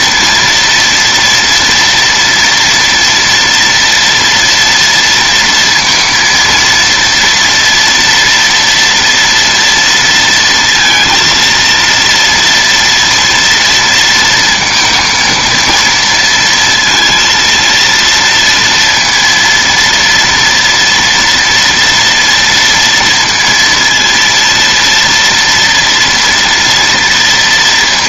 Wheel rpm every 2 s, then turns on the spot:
230, 230, 230, 230, 230, 230, 240, 230, 230, 230, 230, 230, 230, 230.
none